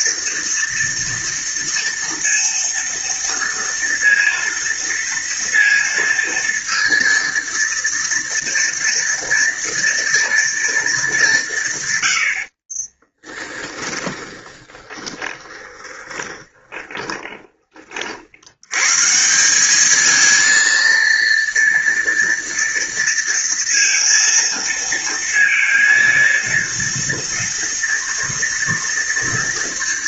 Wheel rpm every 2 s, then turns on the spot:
230, 230, 230, 230, 230, 220, 40, 30, 20, 110, 230, 230, 230, 230, 230.
12-18